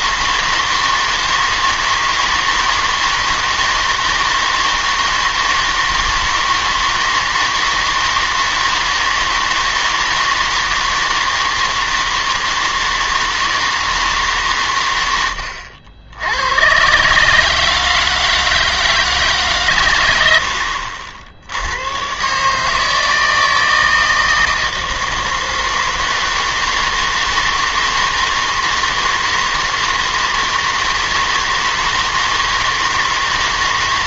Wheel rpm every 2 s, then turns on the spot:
160, 160, 160, 160, 160, 160, 160, 120, 110, 160, 70, 150, 160, 160, 160, 160, 160.
none